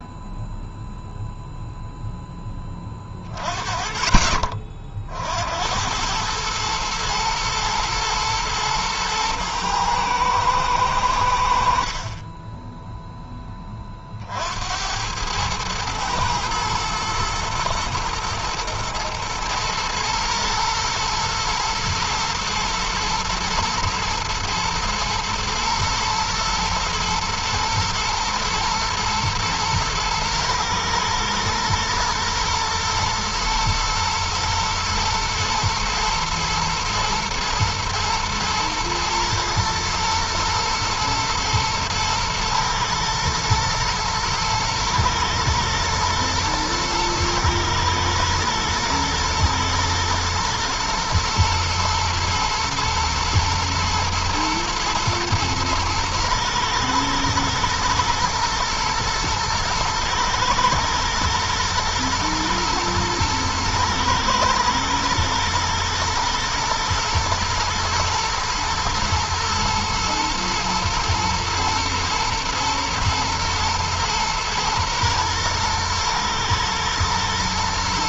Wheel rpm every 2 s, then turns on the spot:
0, 20, 50, 110, 110, 90, 10, 100, 120, 120, 110, 110, 110, 120, 110, 110, 110, 110, 110, 110, 110, 110, 120, 120, 120, 120, 110, 120, 110, 110, 110, 120, 120, 120, 110, 110, 110, 110, 110.
none